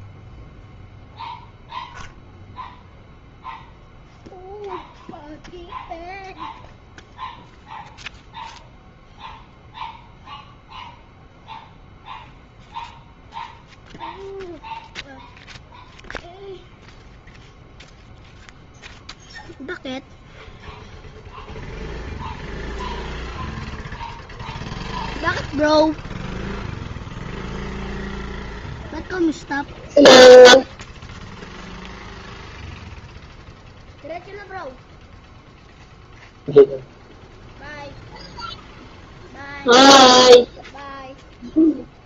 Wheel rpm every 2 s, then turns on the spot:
0, 0, 0, 0, 0, 0, 0, 0, 0, 0, 0, 0, 0, 0, 0, 0, 0, 0, 0, 0, 0.
none